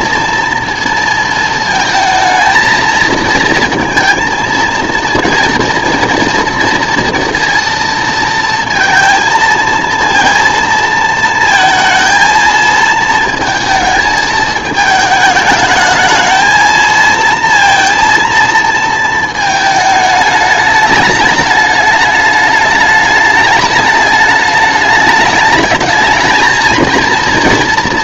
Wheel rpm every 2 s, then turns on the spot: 230, 230, 230, 230, 230, 230, 220, 220, 230, 230, 220, 210, 210, 220.
none